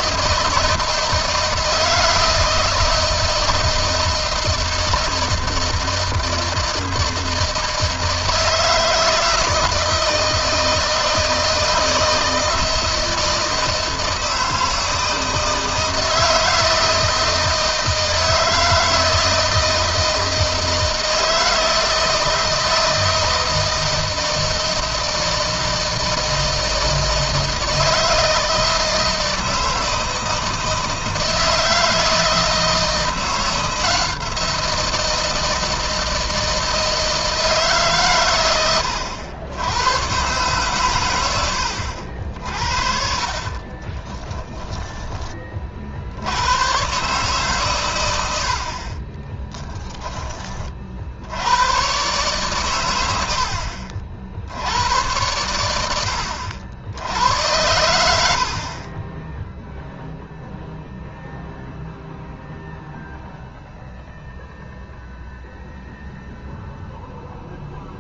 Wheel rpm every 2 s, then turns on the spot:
160, 160, 160, 160, 160, 160, 160, 160, 160, 160, 160, 160, 160, 160, 160, 160, 170, 170, 160, 100, 120, 60, 20, 130, 40, 60, 100, 90, 90, 30, 0, 0, 0, 0.
42-44 48-50 58-60